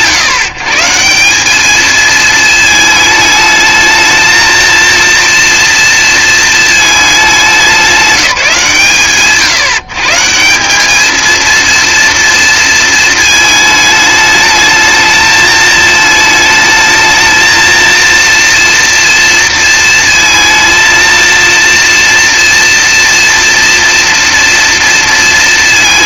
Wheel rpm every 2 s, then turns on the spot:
140, 220, 230, 220, 140, 200, 230, 220, 220, 230, 220, 230, 230.
none